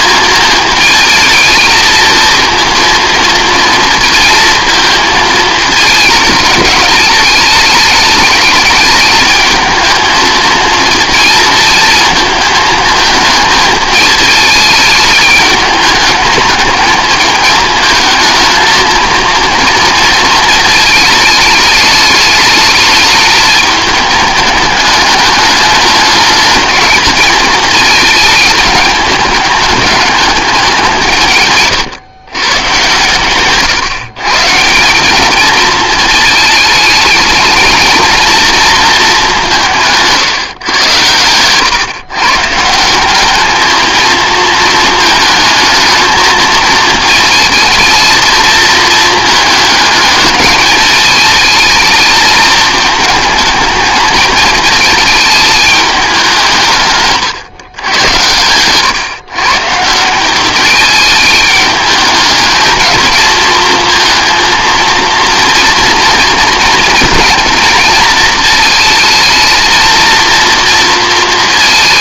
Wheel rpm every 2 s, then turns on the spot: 220, 230, 220, 220, 220, 230, 220, 210, 210, 230, 220, 220, 210, 210, 210, 180, 130, 160, 220, 220, 110, 170, 230, 220, 220, 210, 220, 220, 160, 120, 210, 220, 220, 230, 220, 230.
none